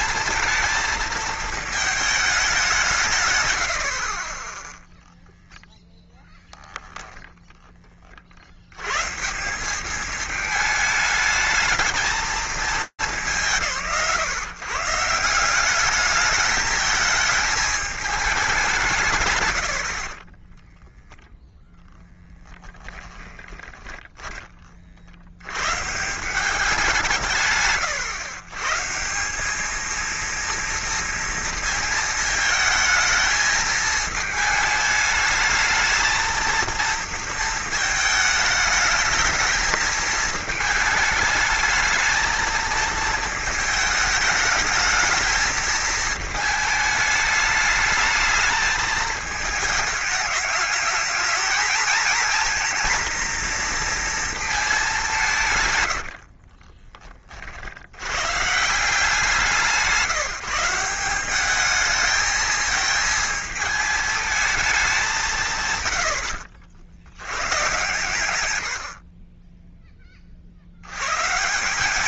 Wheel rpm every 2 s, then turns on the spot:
220, 180, 10, 0, 90, 210, 180, 150, 220, 160, 0, 20, 60, 170, 170, 230, 220, 220, 230, 220, 220, 220, 220, 210, 220, 210, 230, 190, 30, 170, 180, 220, 190, 60, 80, 80.
22-24